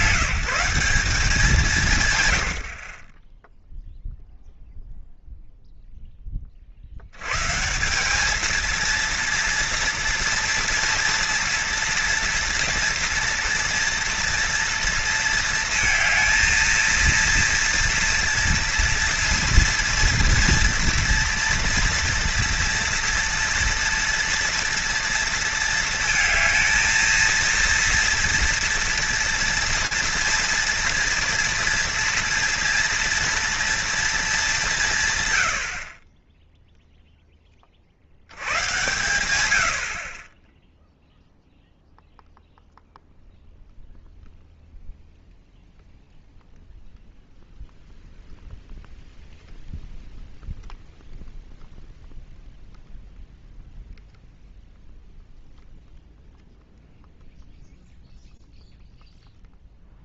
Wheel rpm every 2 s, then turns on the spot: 180, 90, 0, 20, 210, 230, 230, 230, 220, 230, 230, 240, 230, 230, 230, 230, 230, 210, 10, 90, 20, 0, 0, 0, 0, 0, 0, 0, 0, 0.
none